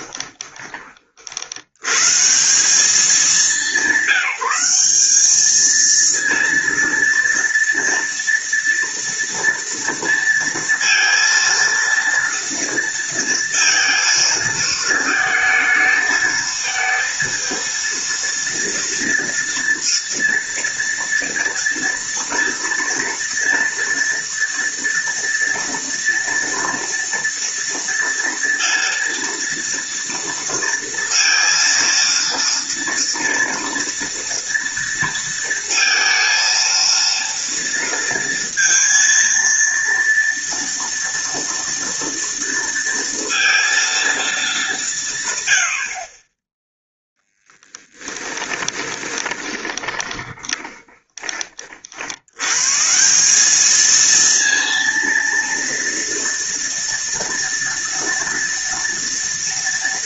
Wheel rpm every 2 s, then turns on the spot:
40, 190, 190, 230, 230, 230, 230, 220, 220, 230, 240, 230, 230, 230, 230, 230, 230, 230, 230, 230, 230, 230, 190, 10, 20, 20, 140, 230, 240, 230.
48-52